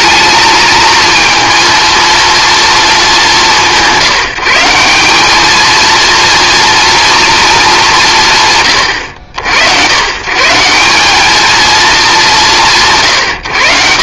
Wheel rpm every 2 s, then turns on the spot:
220, 220, 190, 230, 110, 190, 150.
none